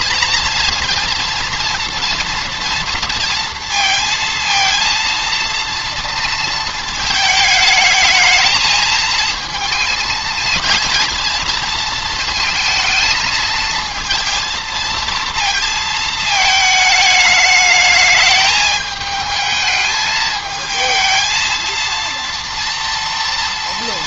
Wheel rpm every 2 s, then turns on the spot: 230, 230, 230, 230, 220, 230, 230, 230, 220, 210, 220, 230.
none